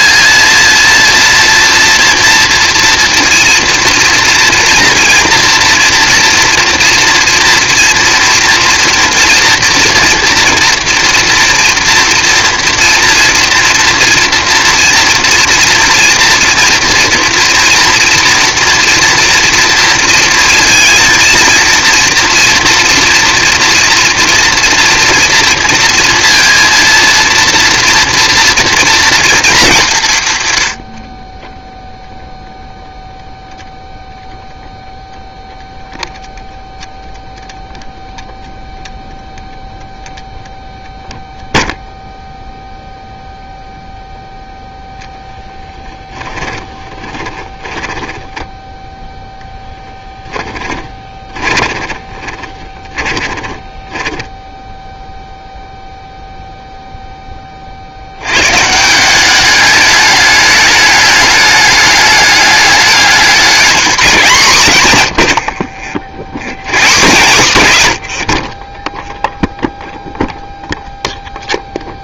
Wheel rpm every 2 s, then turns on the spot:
230, 230, 230, 230, 240, 240, 230, 230, 230, 230, 230, 230, 230, 230, 230, 60, 0, 0, 0, 0, 0, 0, 0, 10, 10, 10, 20, 0, 0, 160, 210, 210, 160, 120, 10, 0.
46-54